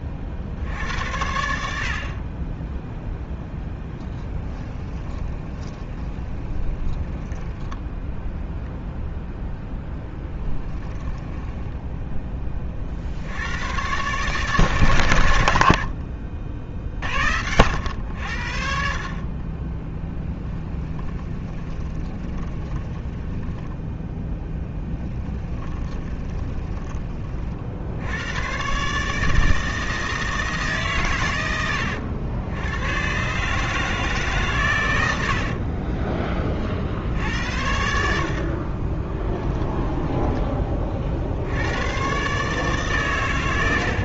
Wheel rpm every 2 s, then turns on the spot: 70, 10, 20, 30, 0, 10, 40, 130, 50, 50, 10, 20, 10, 20, 130, 140, 100, 110, 50, 30, 30, 140.
4-8 10-12 20-28 38-40